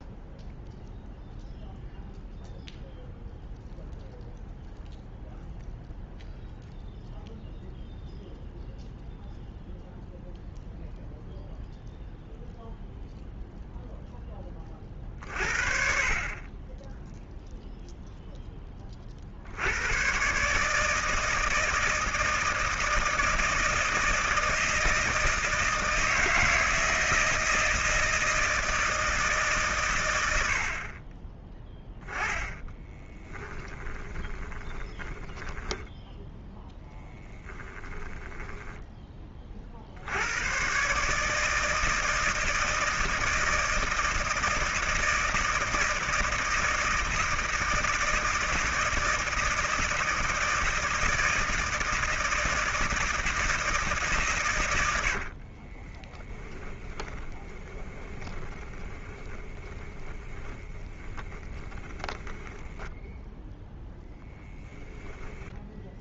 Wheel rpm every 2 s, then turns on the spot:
0, 0, 0, 0, 0, 0, 0, 30, 10, 10, 150, 160, 160, 160, 160, 50, 20, 10, 10, 10, 140, 160, 160, 160, 160, 160, 160, 100, 10, 20, 10, 10, 0.
32-38 56-62